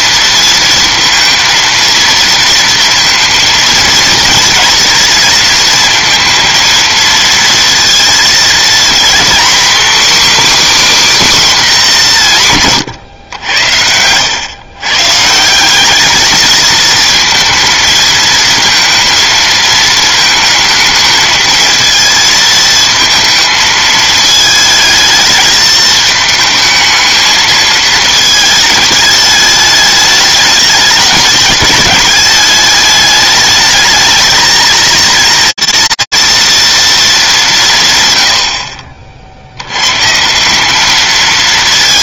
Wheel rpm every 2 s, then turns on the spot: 230, 230, 230, 230, 230, 290, 150, 120, 220, 230, 220, 220, 220, 220, 220, 210, 210, 220, 230, 90, 190.
none